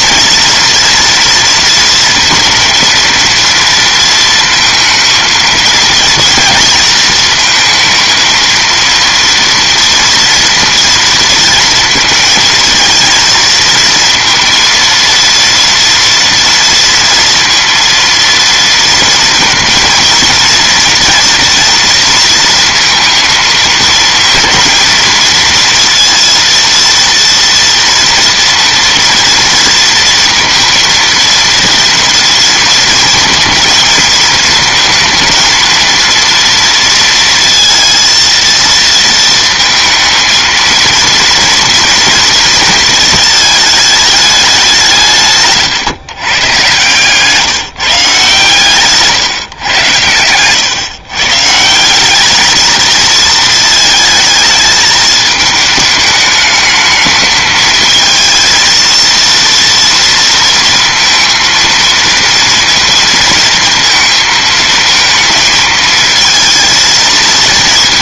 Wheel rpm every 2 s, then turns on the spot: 230, 230, 220, 230, 230, 230, 220, 230, 230, 230, 230, 230, 230, 230, 230, 230, 230, 220, 230, 230, 230, 230, 190, 140, 140, 130, 220, 220, 220, 230, 230, 230, 220, 220.
none